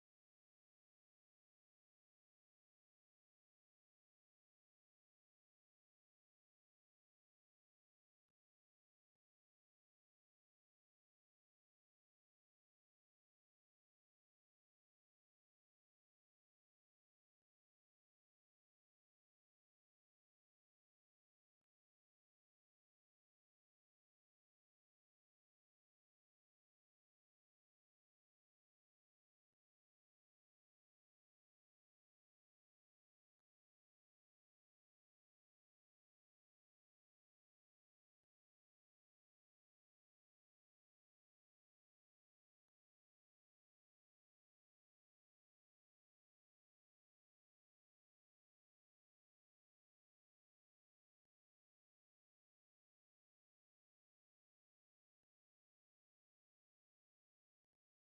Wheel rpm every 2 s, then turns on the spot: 0, 0, 0, 0, 0, 0, 0, 0, 0, 0, 0, 0, 0, 0, 0, 0, 0, 0, 0, 0, 0, 0, 0, 0, 0, 0, 0, 0, 0.
none